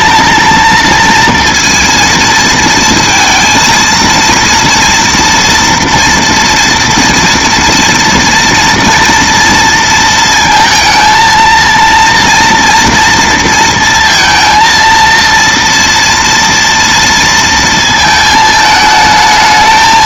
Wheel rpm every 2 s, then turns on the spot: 230, 230, 230, 230, 230, 230, 230, 230, 230, 220.
none